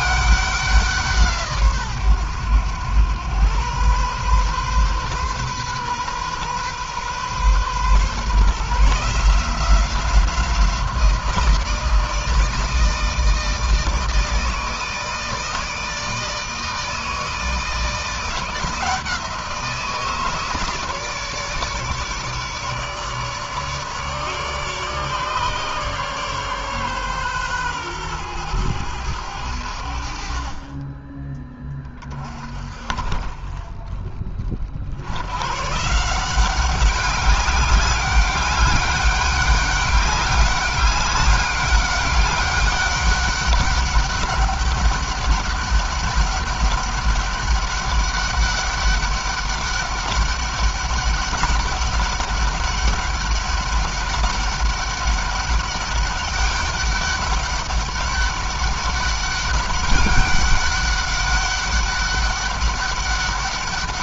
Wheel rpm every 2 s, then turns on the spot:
180, 110, 130, 130, 160, 170, 160, 160, 160, 170, 160, 150, 150, 140, 110, 30, 40, 60, 190, 200, 200, 200, 200, 200, 200, 200, 200, 200, 200, 200, 190, 200.
none